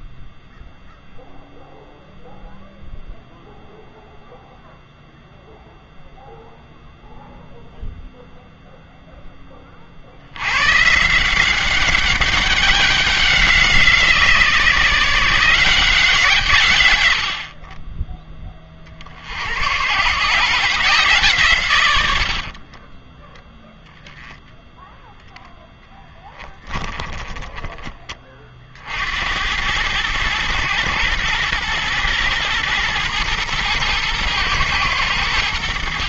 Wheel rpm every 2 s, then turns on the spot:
0, 0, 0, 0, 0, 130, 190, 160, 140, 30, 150, 30, 0, 10, 40, 120, 120, 110.
22-24 26-28